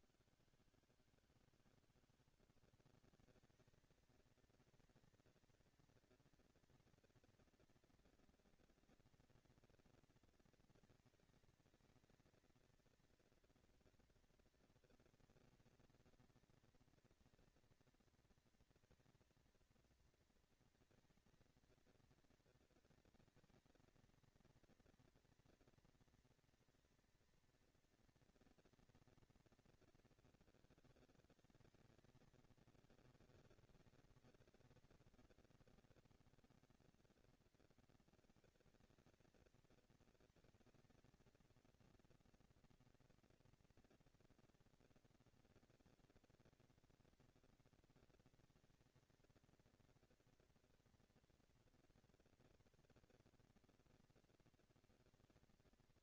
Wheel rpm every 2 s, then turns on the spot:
160, 160, 220, 230, 230, 230, 230, 230, 230, 230, 230, 230, 230, 230, 230, 220, 210, 190, 200, 230, 230, 240, 230, 230, 230, 230, 240, 230.
none